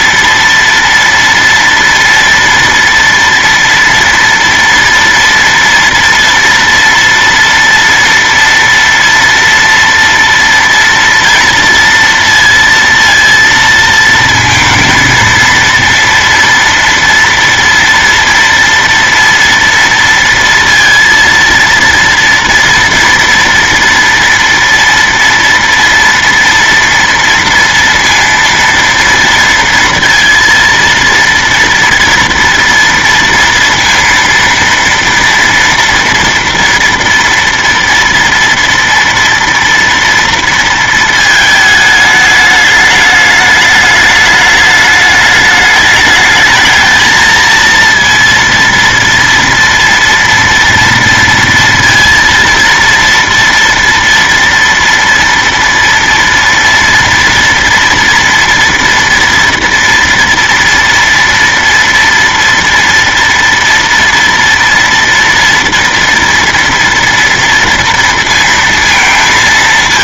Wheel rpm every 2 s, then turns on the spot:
230, 230, 230, 230, 230, 230, 230, 230, 230, 230, 230, 240, 230, 230, 230, 230, 230, 230, 230, 230, 230, 210, 210, 220, 230, 230, 230, 230, 230, 230, 230, 230, 230, 230, 230.
none